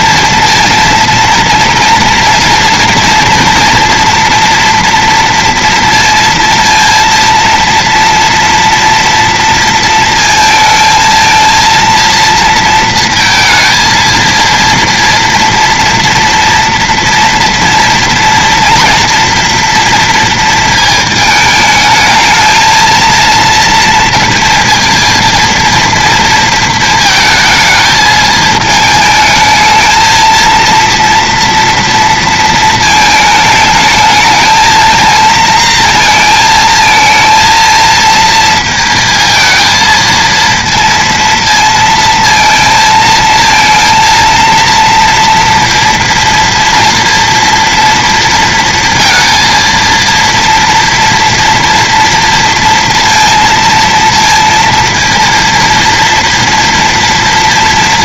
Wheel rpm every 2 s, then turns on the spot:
230, 230, 230, 230, 230, 220, 230, 230, 230, 230, 230, 220, 230, 230, 220, 230, 220, 220, 220, 230, 230, 230, 230, 230, 230, 230, 230, 230, 230.
none